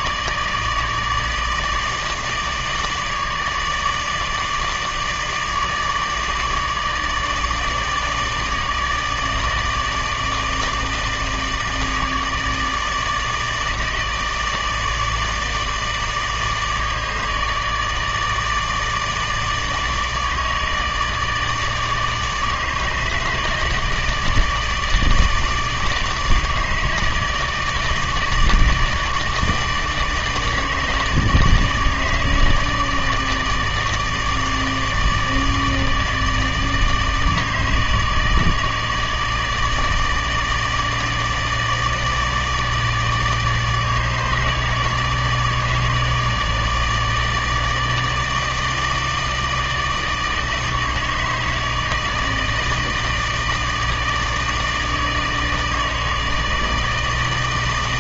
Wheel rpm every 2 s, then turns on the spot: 150, 150, 150, 160, 160, 160, 160, 150, 150, 160, 150, 150, 150, 160, 150, 150, 150, 150, 160, 150, 160, 160, 150, 160, 160, 160, 160, 160, 160.
none